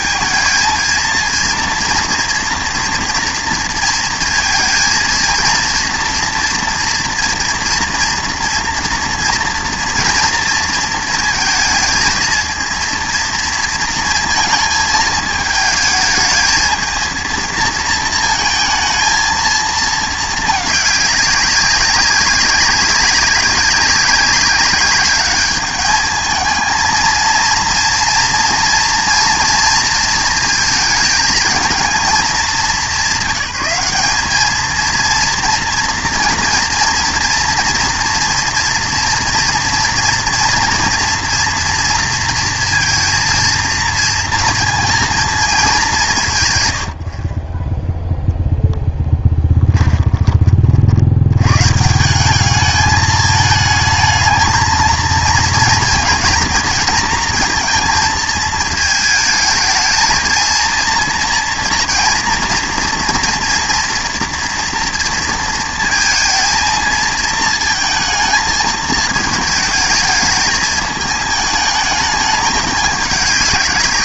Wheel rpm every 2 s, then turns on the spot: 230, 230, 230, 240, 230, 230, 230, 220, 220, 220, 210, 200, 200, 220, 230, 230, 200, 220, 230, 230, 230, 230, 230, 110, 0, 40, 210, 220, 230, 220, 230, 230, 230, 230, 220, 220, 210.
none